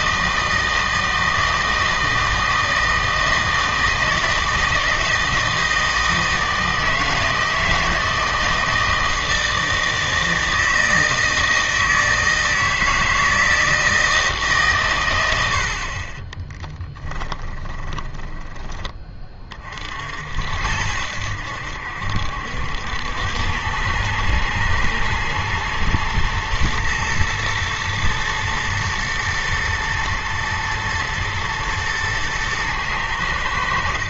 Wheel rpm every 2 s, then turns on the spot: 160, 160, 160, 160, 160, 160, 160, 140, 10, 20, 70, 80, 110, 120, 110, 110, 110.
16-20